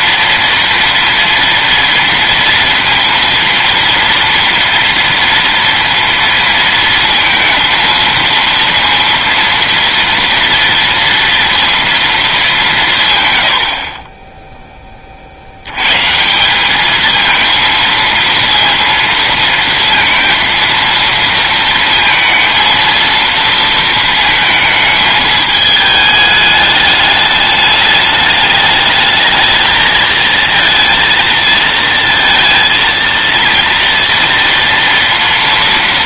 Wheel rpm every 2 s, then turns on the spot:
230, 230, 230, 230, 230, 230, 190, 10, 200, 230, 230, 230, 220, 210, 210, 230, 230, 230.
none